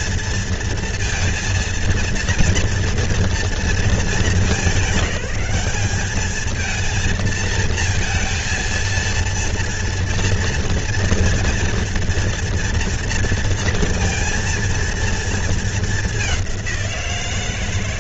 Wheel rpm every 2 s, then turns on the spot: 230, 230, 210, 230, 230, 230, 230, 230, 170.
none